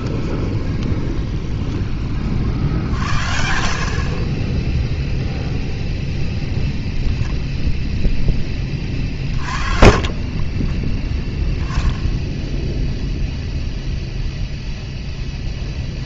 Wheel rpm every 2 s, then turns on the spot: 20, 60, 10, 0, 30, 20, 0, 0.
0-2 10-12